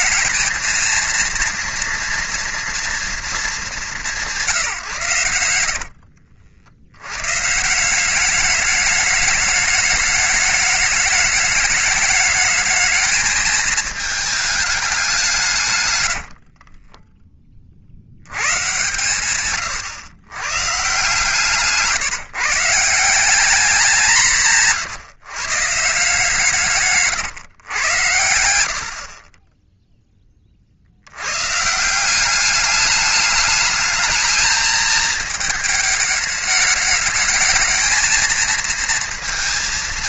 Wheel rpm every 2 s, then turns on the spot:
230, 230, 160, 70, 200, 210, 210, 210, 50, 100, 130, 150, 160, 150, 70, 40, 200, 220, 220, 220.
16-18 24-26